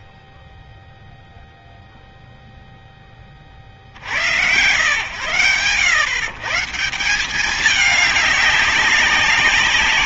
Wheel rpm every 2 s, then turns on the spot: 0, 50, 110, 200, 190.
none